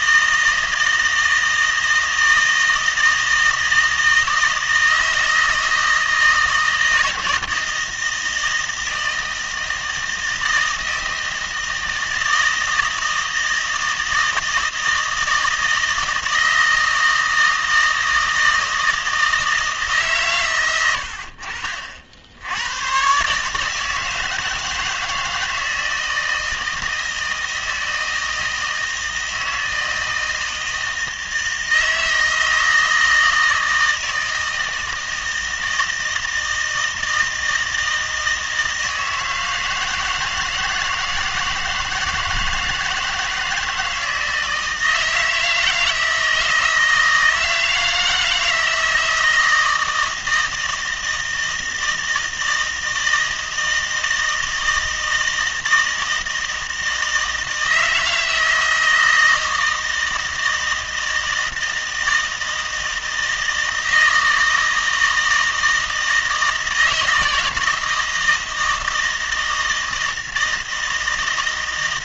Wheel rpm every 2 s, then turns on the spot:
160, 160, 160, 160, 160, 160, 160, 160, 160, 160, 120, 80, 160, 160, 160, 160, 160, 160, 160, 160, 160, 160, 160, 160, 160, 160, 160, 160, 160, 160, 160, 160, 160, 160, 160, 160.
none